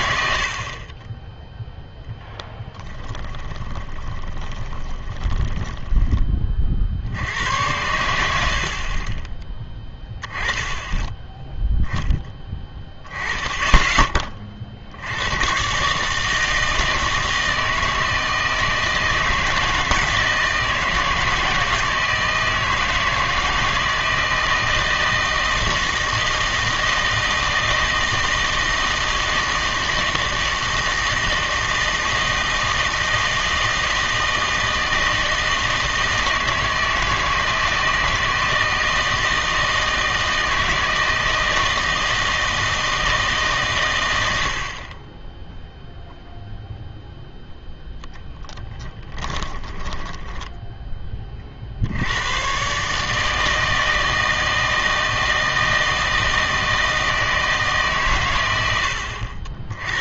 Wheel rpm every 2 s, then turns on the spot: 60, 20, 20, 30, 70, 20, 10, 50, 160, 160, 160, 160, 160, 160, 160, 160, 160, 160, 160, 160, 160, 160, 70, 0, 10, 10, 130, 160, 160, 100.
2-6 48-50